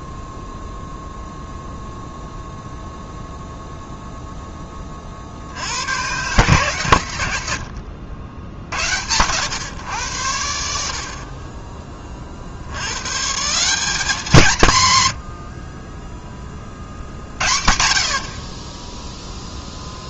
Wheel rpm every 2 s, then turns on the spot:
0, 0, 60, 90, 100, 30, 150, 90, 70, 0.
none